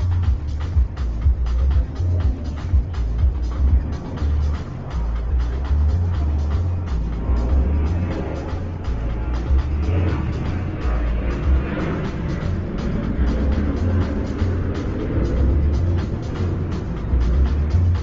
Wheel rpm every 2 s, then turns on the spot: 0, 0, 0, 0, 0, 0, 0, 0, 0.
none